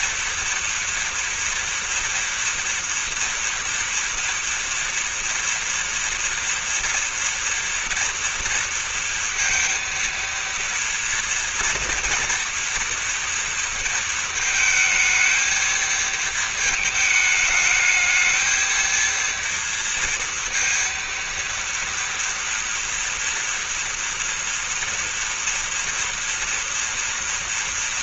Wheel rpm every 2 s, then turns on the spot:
230, 230, 230, 230, 230, 230, 230, 220, 220, 230, 230, 230, 230, 240.
none